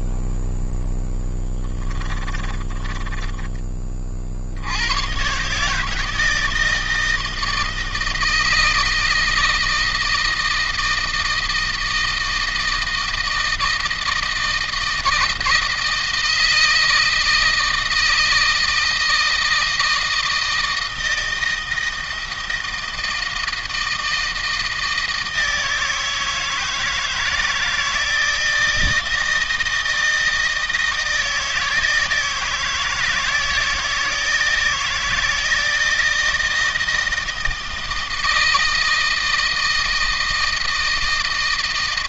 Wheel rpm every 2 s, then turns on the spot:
10, 30, 110, 160, 160, 160, 160, 160, 160, 160, 160, 160, 160, 160, 160, 160, 160, 160, 160, 160, 160.
0-4